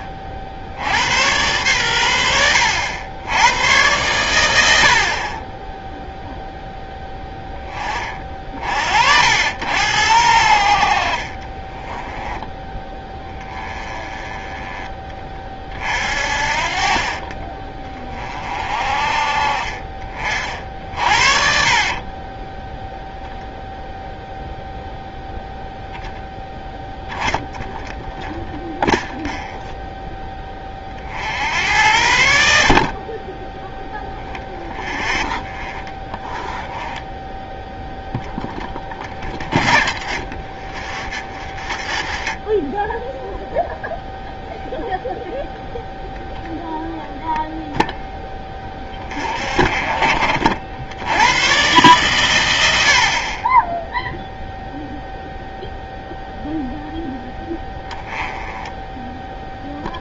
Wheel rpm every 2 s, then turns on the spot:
80, 80, 70, 0, 60, 50, 10, 20, 40, 40, 50, 0, 0, 10, 0, 30, 40, 0, 10, 20, 40, 20, 0, 0, 20, 80, 70, 0, 0, 10.
16-18 20-22